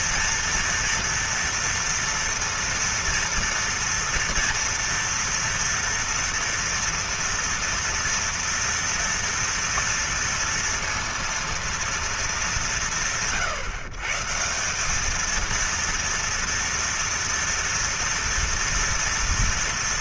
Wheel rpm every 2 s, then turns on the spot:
230, 230, 230, 230, 230, 230, 160, 180, 230, 230.
none